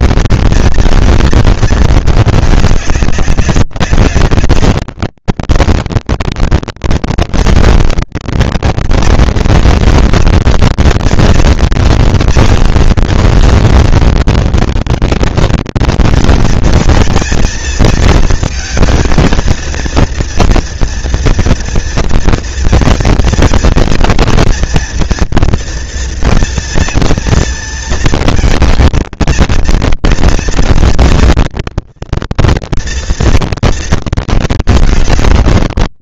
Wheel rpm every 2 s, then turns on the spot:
230, 200, 190, 220, 220, 230, 230, 230, 230, 230, 230, 230, 230, 230, 220, 230, 230, 210.
none